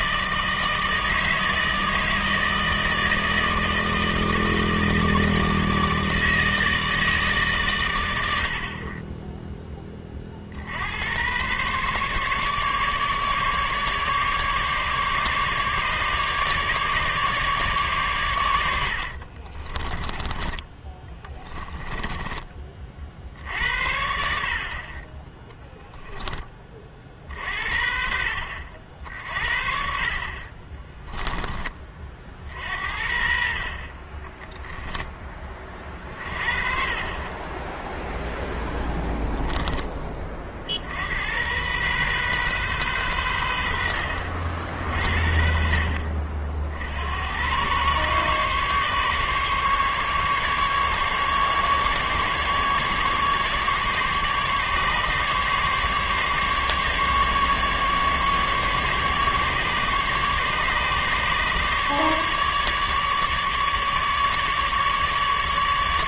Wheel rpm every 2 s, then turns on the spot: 160, 160, 160, 160, 30, 80, 150, 150, 150, 80, 20, 40, 30, 50, 60, 20, 60, 10, 30, 10, 70, 120, 50, 70, 140, 140, 150, 140, 140, 150, 140, 150, 150.
18-20 30-32